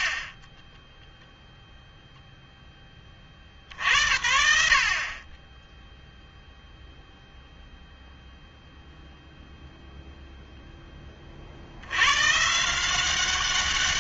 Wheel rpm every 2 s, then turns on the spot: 40, 10, 70, 0, 0, 10, 160.
0-2